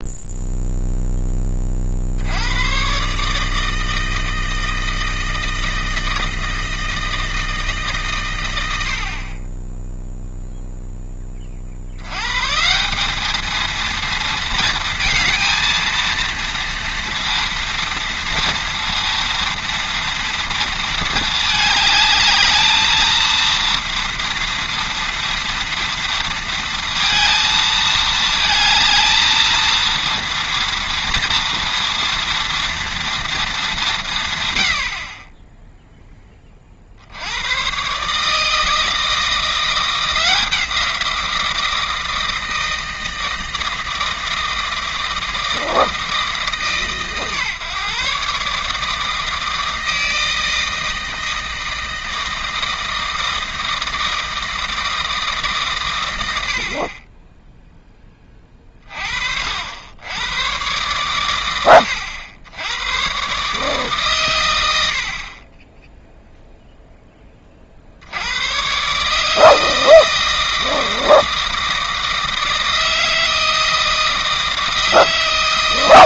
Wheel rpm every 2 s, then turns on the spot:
0, 110, 160, 160, 90, 0, 150, 230, 230, 230, 230, 210, 230, 230, 220, 230, 230, 90, 40, 160, 170, 160, 160, 150, 150, 160, 160, 160, 50, 30, 120, 100, 90, 0, 120, 160, 160, 160.
none